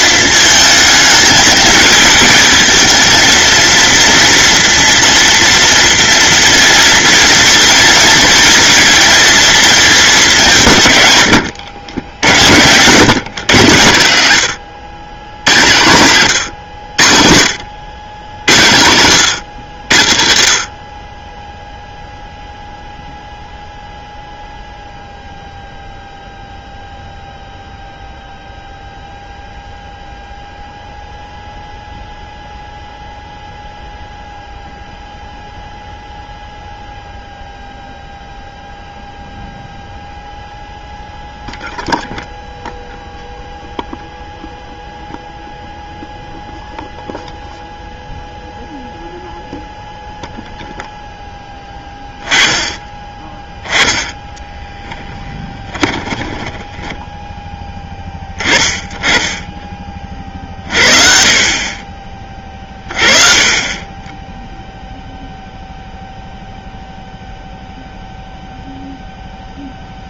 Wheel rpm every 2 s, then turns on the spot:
220, 230, 230, 230, 230, 150, 120, 110, 80, 100, 30, 0, 0, 0, 0, 0, 0, 0, 0, 0, 0, 0, 0, 0, 0, 0, 10, 10, 20, 20, 50, 30, 0, 0, 0.
54-58